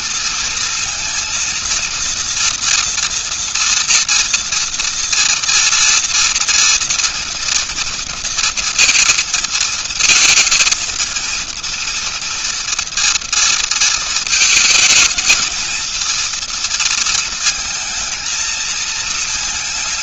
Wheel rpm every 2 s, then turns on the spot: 230, 230, 230, 230, 230, 220, 230, 220, 230, 220.
none